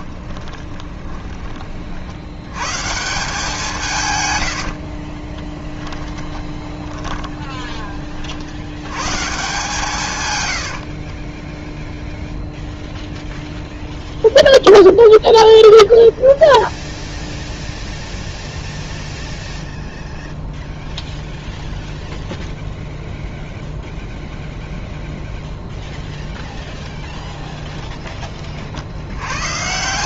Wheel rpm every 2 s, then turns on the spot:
20, 130, 80, 20, 90, 80, 0, 0, 0, 0, 0, 0, 0, 0, 40.
0-2 4-8 10-12